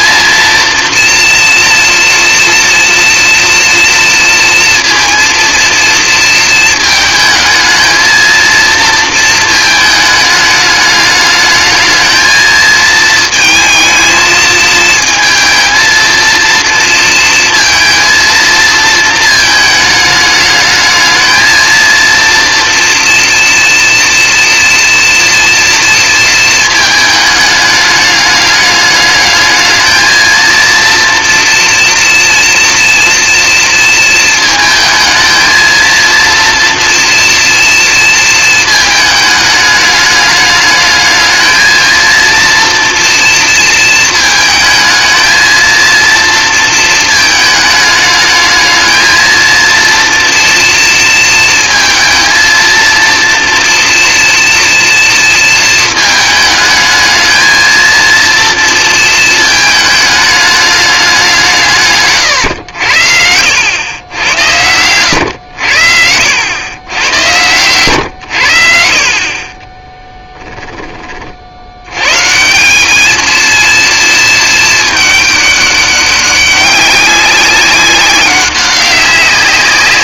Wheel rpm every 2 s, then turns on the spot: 230, 230, 230, 220, 230, 210, 220, 230, 230, 230, 210, 230, 230, 230, 210, 230, 230, 220, 230, 230, 210, 230, 220, 230, 220, 240, 230, 230, 220, 230, 210, 120, 100, 100, 90, 10, 180, 220, 190, 190.
70-72